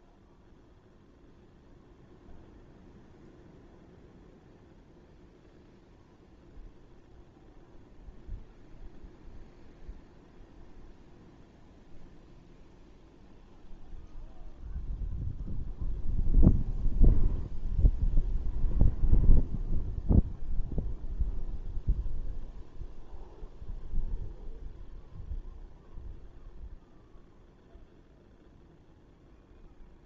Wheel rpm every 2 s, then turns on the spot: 0, 0, 0, 0, 0, 0, 0, 0, 0, 0, 0, 0, 0, 0, 0.
none